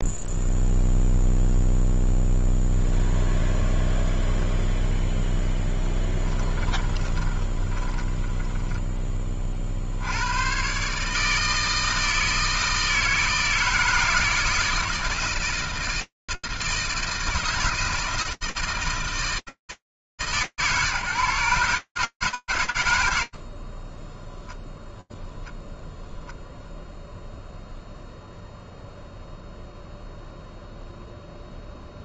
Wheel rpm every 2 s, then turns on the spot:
0, 0, 0, 20, 10, 120, 160, 160, 160, 150, 110, 0, 0, 0, 0, 0.
6-10